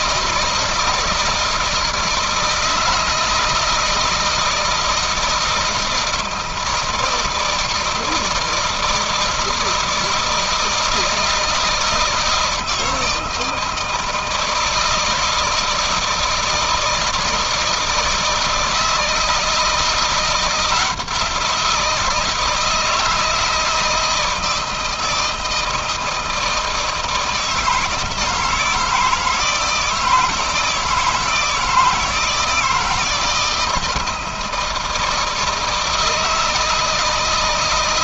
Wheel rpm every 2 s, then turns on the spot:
160, 160, 160, 160, 160, 160, 160, 160, 160, 160, 170, 160, 160, 160, 160, 160, 160, 160, 160.
none